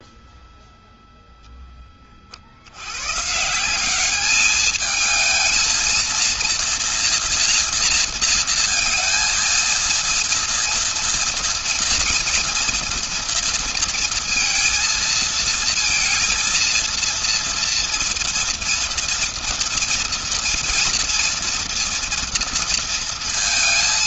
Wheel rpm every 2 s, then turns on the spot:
0, 60, 210, 230, 230, 230, 240, 230, 230, 230, 230, 230.
none